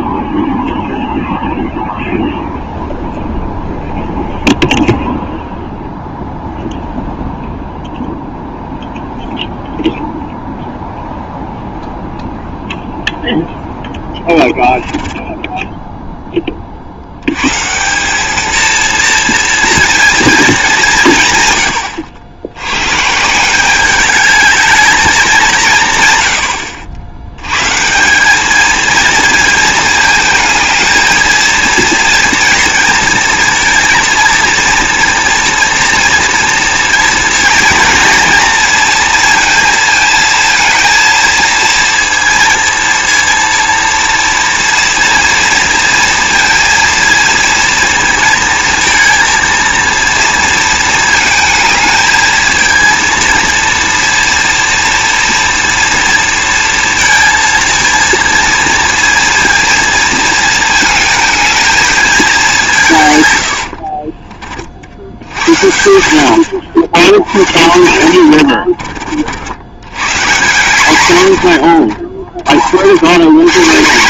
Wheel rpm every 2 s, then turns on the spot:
0, 0, 0, 0, 0, 0, 0, 10, 30, 220, 210, 100, 210, 80, 220, 220, 230, 230, 230, 230, 230, 230, 230, 230, 230, 230, 220, 230, 230, 230, 220, 180, 40, 80, 50, 140, 70.
14-16 66-70